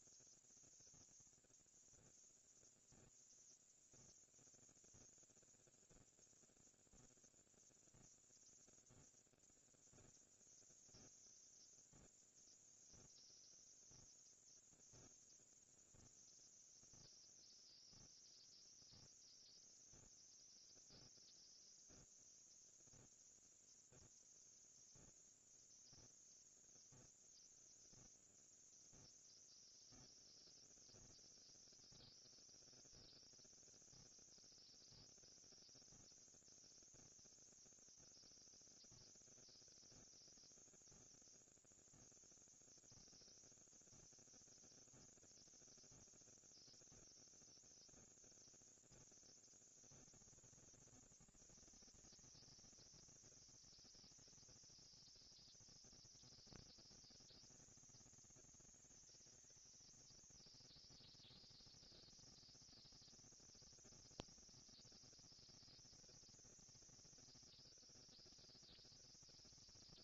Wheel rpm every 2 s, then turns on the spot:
0, 0, 0, 0, 0, 0, 0, 0, 0, 0, 0, 0, 0, 0, 0, 0, 0, 0, 0, 0, 0, 0, 0, 0, 10, 190, 220, 220, 230, 220, 230, 230, 190, 200, 220.
none